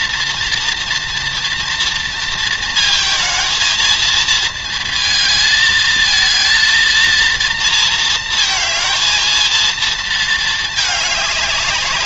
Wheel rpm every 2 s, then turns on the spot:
230, 230, 220, 220, 230, 220.
none